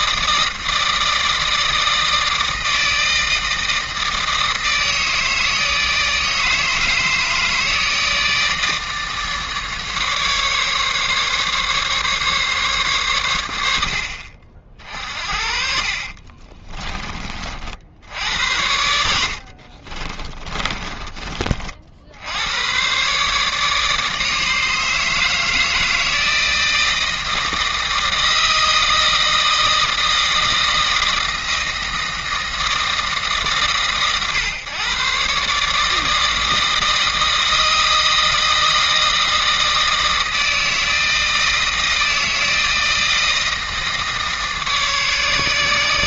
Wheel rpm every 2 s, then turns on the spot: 160, 160, 160, 160, 160, 140, 140, 50, 20, 80, 30, 110, 150, 160, 160, 160, 160, 130, 160, 160, 160, 160, 150.
16-18 20-22